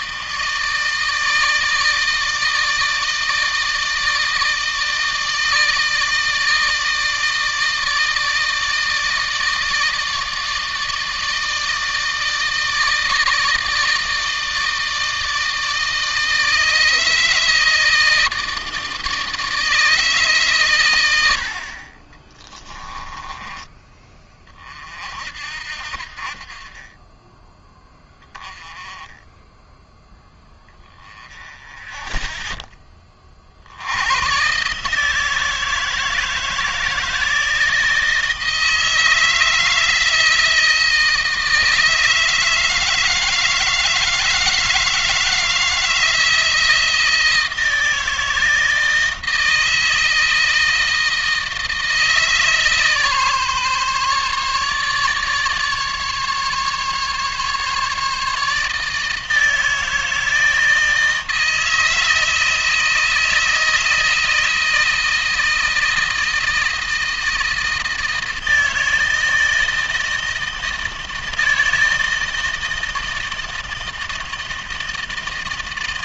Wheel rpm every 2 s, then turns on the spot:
160, 160, 160, 160, 160, 160, 160, 160, 160, 160, 110, 20, 40, 30, 10, 10, 20, 150, 160, 160, 160, 160, 160, 160, 160, 160, 150, 150, 150, 160, 160, 160, 160, 160, 160, 160, 160, 160.
22-24